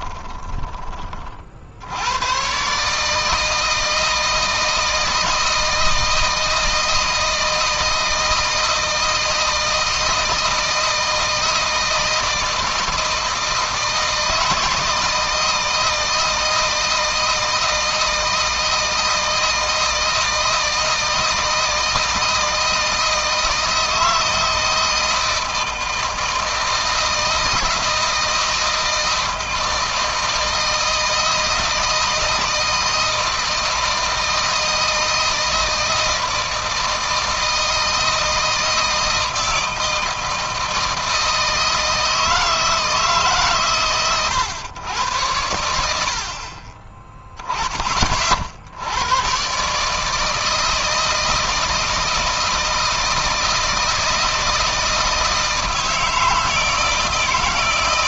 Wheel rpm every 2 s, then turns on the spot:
30, 150, 160, 160, 160, 160, 160, 160, 160, 160, 160, 160, 160, 160, 160, 160, 160, 160, 160, 160, 160, 150, 90, 20, 80, 160, 160, 160, 160.
none